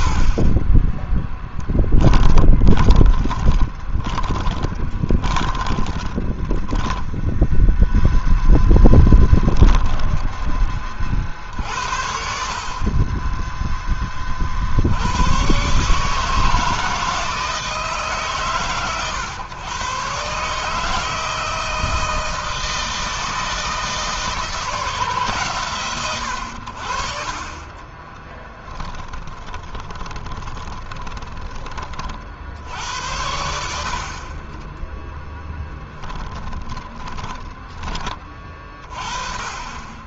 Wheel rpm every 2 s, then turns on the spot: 20, 20, 20, 10, 0, 20, 50, 50, 160, 130, 140, 160, 160, 80, 20, 20, 70, 30, 20, 30.
0-8 28-32 36-38